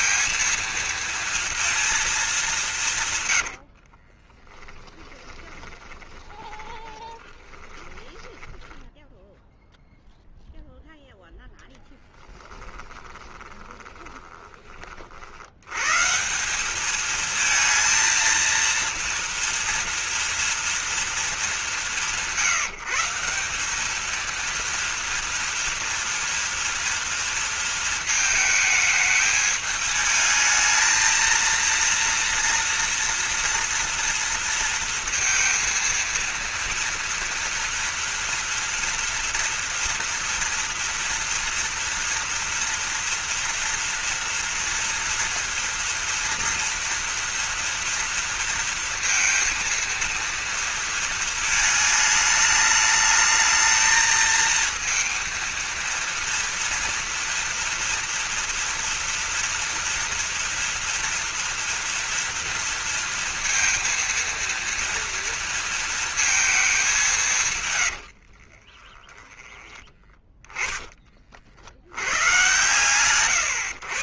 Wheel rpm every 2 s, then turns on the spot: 230, 170, 20, 30, 10, 0, 20, 30, 200, 230, 230, 160, 230, 230, 220, 220, 230, 230, 230, 240, 230, 230, 230, 230, 230, 230, 210, 230, 230, 230, 230, 230, 230, 210, 30, 20, 120.
4-10 12-14 68-70